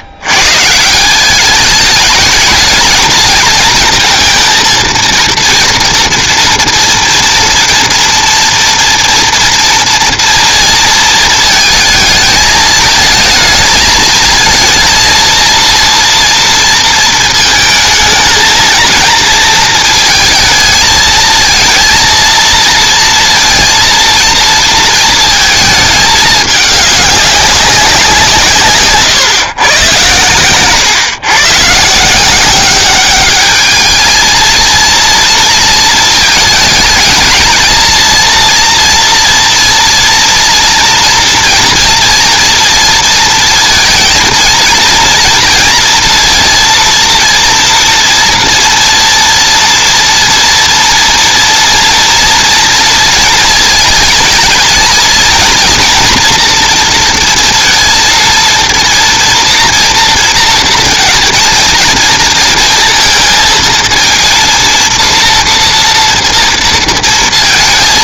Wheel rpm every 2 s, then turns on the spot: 110, 210, 230, 240, 230, 230, 220, 220, 240, 220, 220, 230, 230, 210, 160, 120, 180, 230, 220, 230, 230, 230, 230, 230, 230, 230, 230, 220, 230, 230, 230, 230, 230, 230.
none